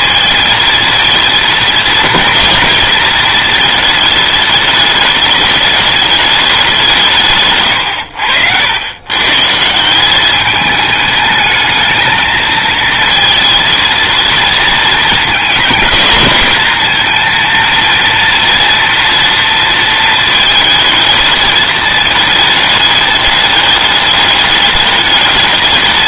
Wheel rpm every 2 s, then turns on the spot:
230, 230, 210, 190, 100, 210, 230, 230, 230, 230, 220, 210, 210.
none